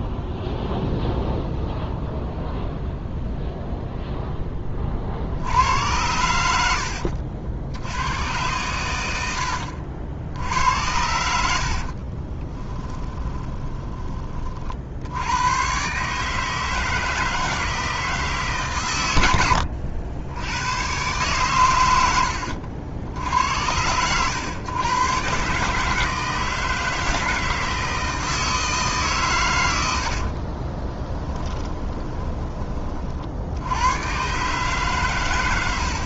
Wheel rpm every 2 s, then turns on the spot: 0, 0, 40, 80, 100, 90, 20, 60, 160, 130, 110, 60, 110, 160, 150, 20, 30, 130.
6-8 12-14 30-32